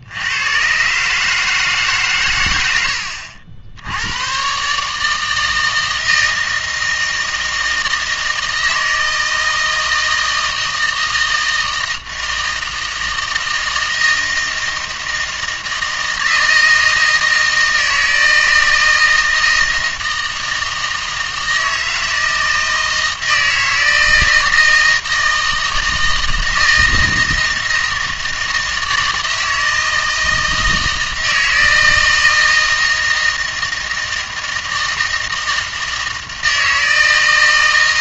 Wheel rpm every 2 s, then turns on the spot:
120, 90, 140, 160, 160, 160, 160, 160, 160, 160, 160, 160, 160, 160, 160, 160, 160, 160, 160.
none